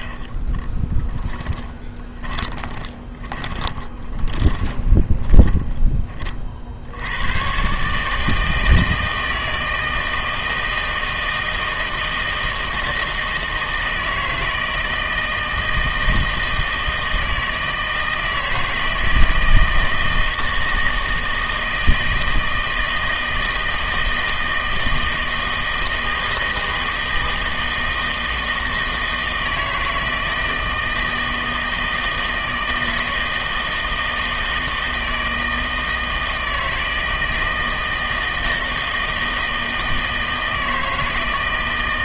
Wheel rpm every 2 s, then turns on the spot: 10, 20, 30, 70, 160, 160, 160, 160, 160, 160, 160, 160, 160, 160, 160, 160, 160, 160, 160, 160, 160.
0-6